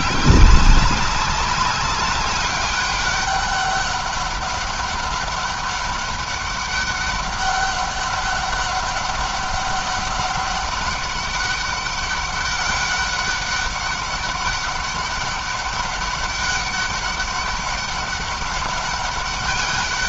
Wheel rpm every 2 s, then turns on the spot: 200, 200, 200, 200, 200, 200, 190, 200, 200, 200.
none